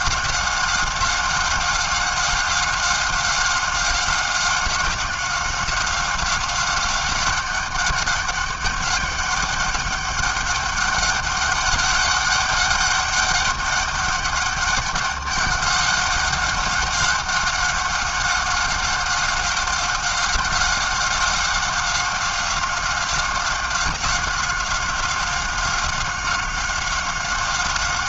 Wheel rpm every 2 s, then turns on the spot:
190, 190, 190, 190, 200, 200, 200, 200, 190, 190, 190, 190, 190, 190.
none